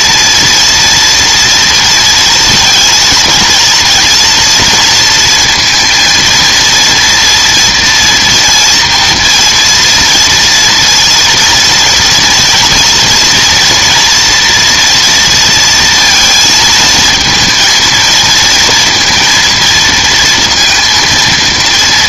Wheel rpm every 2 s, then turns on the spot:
230, 230, 230, 230, 240, 230, 230, 230, 230, 230, 230.
none